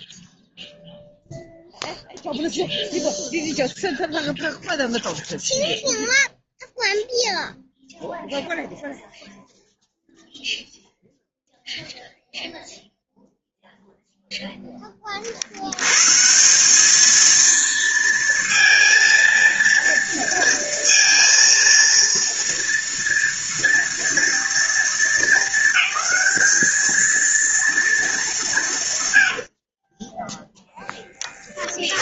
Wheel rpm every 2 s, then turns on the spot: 0, 0, 0, 0, 0, 0, 0, 40, 220, 230, 230, 240, 220, 220, 90, 10.
none